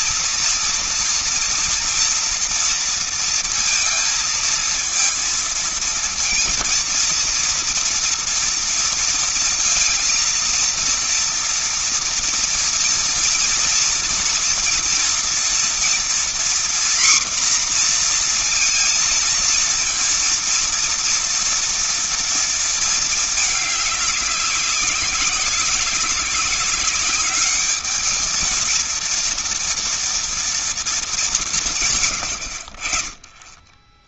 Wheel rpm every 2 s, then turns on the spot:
230, 230, 230, 230, 230, 230, 230, 230, 240, 240, 230, 230, 190, 200, 220, 230, 100.
none